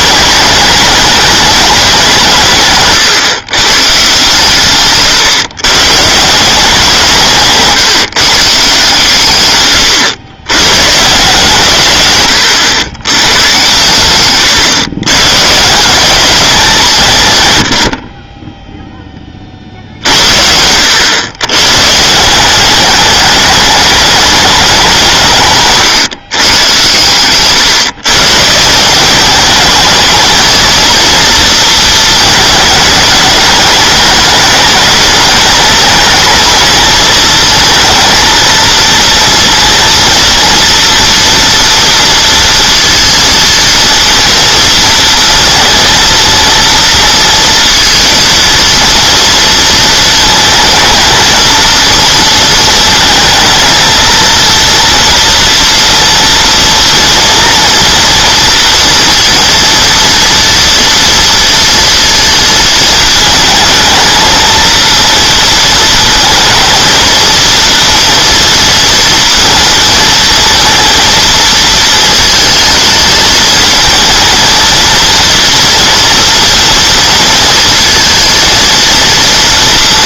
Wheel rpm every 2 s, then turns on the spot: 210, 150, 140, 160, 150, 120, 90, 120, 180, 10, 80, 190, 200, 120, 160, 230, 210, 210, 220, 230, 230, 230, 230, 230, 230, 220, 230, 230, 230, 230, 230, 220, 230, 230, 230, 230, 220, 230, 230, 230.
none